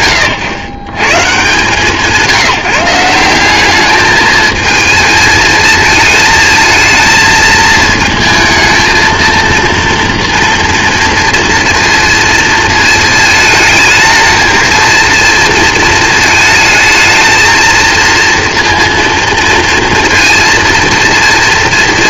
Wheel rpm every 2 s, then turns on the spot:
140, 180, 220, 220, 220, 230, 220, 220, 220, 230, 230.
none